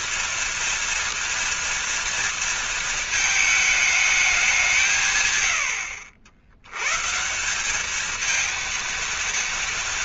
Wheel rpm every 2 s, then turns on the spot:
230, 220, 160, 120, 230.
none